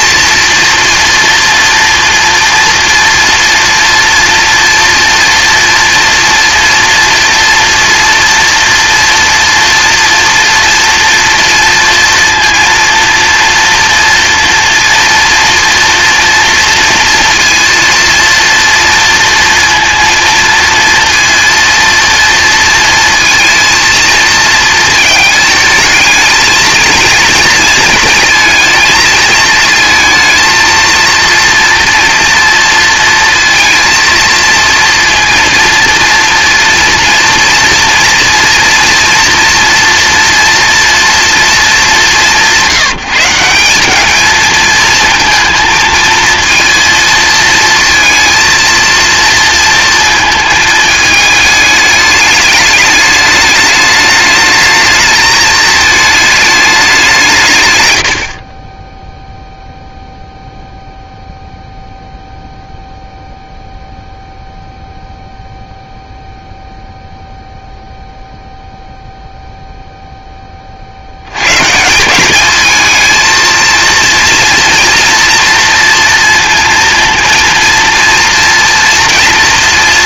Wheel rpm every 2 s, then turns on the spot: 240, 230, 230, 230, 230, 230, 230, 230, 230, 230, 230, 230, 220, 230, 220, 230, 230, 230, 230, 230, 230, 170, 220, 230, 230, 220, 210, 210, 190, 10, 0, 0, 0, 0, 0, 60, 220, 230, 230, 230.
none